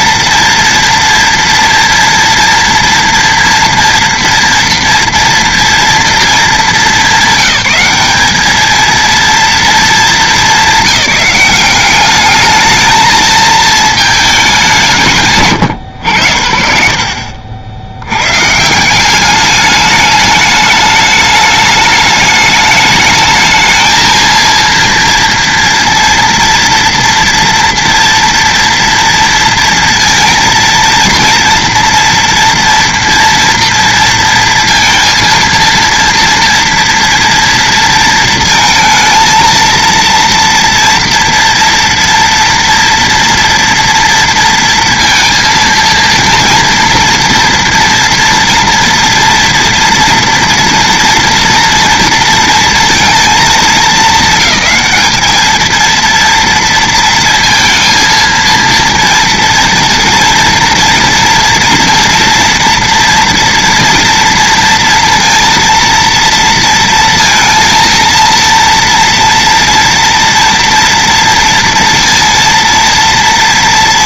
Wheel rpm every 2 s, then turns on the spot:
230, 230, 230, 220, 220, 200, 210, 190, 50, 160, 210, 210, 230, 230, 230, 230, 230, 230, 230, 230, 230, 230, 230, 230, 230, 230, 230, 220, 230, 230, 230, 230, 230, 230, 230, 230, 230.
none